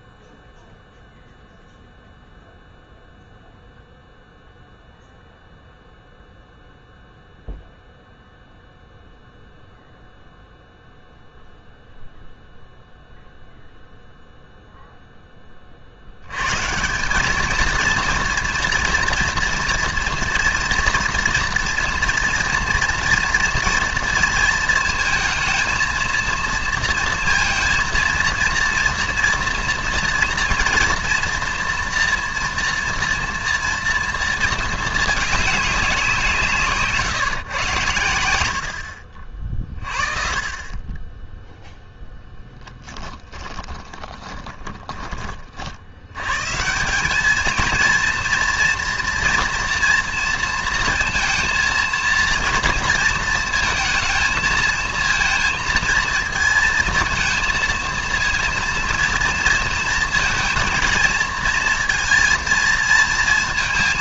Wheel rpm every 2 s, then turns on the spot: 0, 0, 0, 0, 0, 0, 0, 0, 150, 230, 230, 230, 230, 230, 230, 230, 230, 230, 150, 90, 30, 10, 20, 160, 230, 230, 230, 230, 230, 230, 230, 230.
42-46